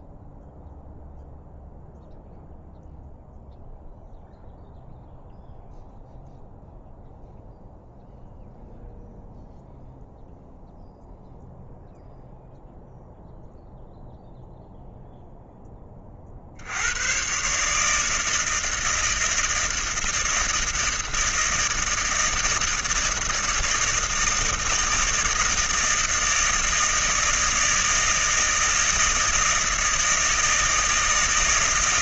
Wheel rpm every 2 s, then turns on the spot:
0, 0, 0, 0, 0, 0, 0, 0, 90, 160, 160, 160, 160, 160, 170, 170.
none